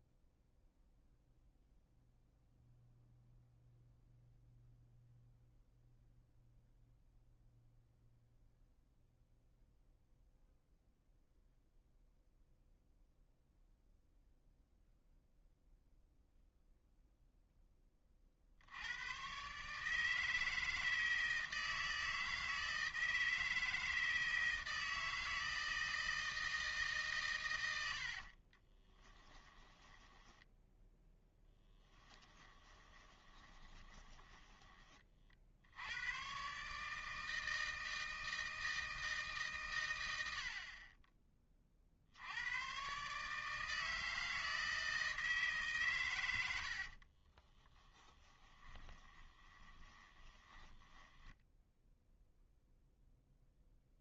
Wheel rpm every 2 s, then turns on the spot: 0, 0, 0, 0, 0, 0, 0, 0, 0, 80, 160, 160, 160, 150, 20, 10, 10, 20, 140, 160, 40, 120, 160, 60, 20, 10, 0.
28-34 46-52